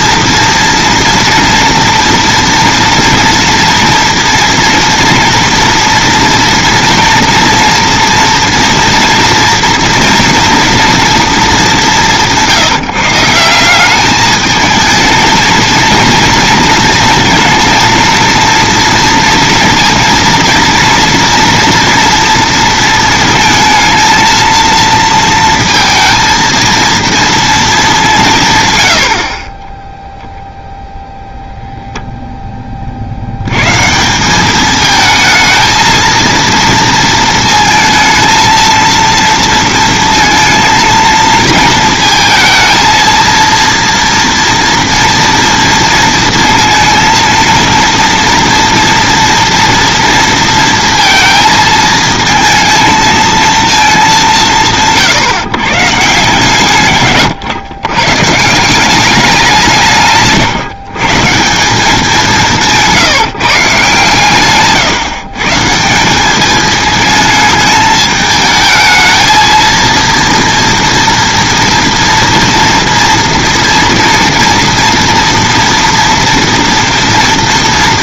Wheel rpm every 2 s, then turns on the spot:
230, 230, 240, 230, 230, 230, 170, 220, 230, 230, 230, 230, 230, 230, 140, 0, 20, 210, 230, 230, 230, 230, 230, 230, 230, 230, 230, 160, 130, 160, 150, 160, 130, 210, 220, 230, 230, 230, 230.
64-66